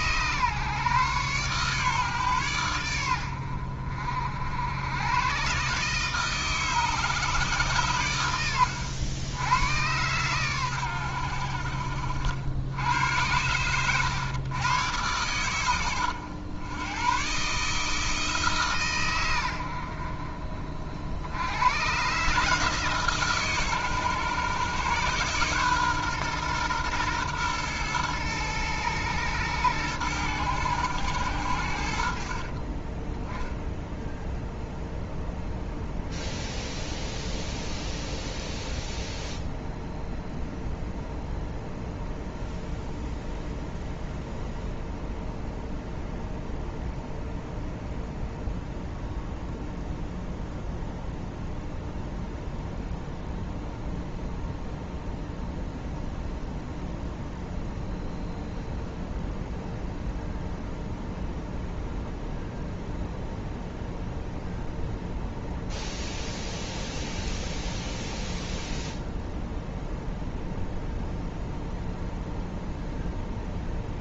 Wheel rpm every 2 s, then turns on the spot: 130, 110, 70, 150, 90, 110, 90, 110, 110, 140, 40, 150, 130, 120, 110, 100, 30, 0, 0, 0, 0, 0, 0, 0, 0, 0, 0, 0, 0, 0, 0, 0, 0, 0, 0, 0, 0.
32-34